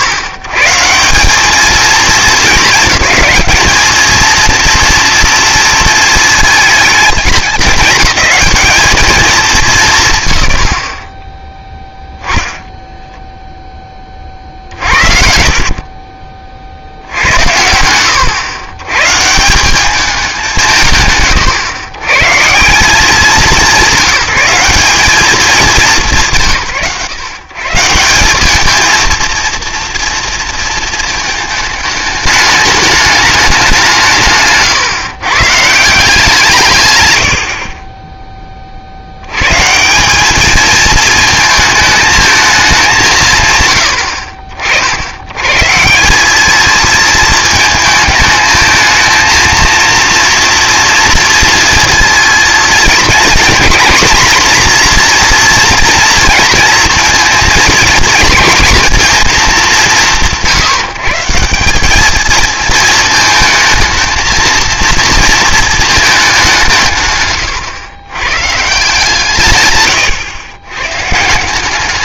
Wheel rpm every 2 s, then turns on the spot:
100, 210, 230, 220, 220, 110, 10, 50, 60, 110, 170, 150, 200, 130, 220, 230, 210, 150, 150, 30, 220, 210, 50, 220, 220, 240, 230, 240, 230, 230, 170, 220, 230, 170, 130, 110.
12-16 34-36